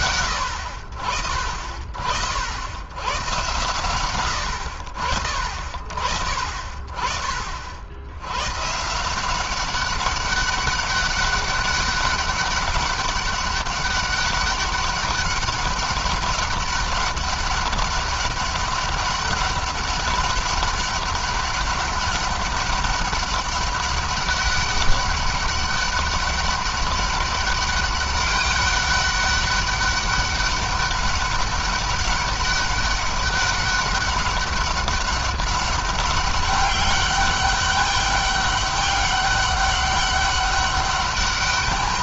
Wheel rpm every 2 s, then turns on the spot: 60, 110, 30, 50, 160, 200, 200, 200, 200, 200, 200, 200, 200, 200, 200, 200, 200, 200, 200, 200, 200.
none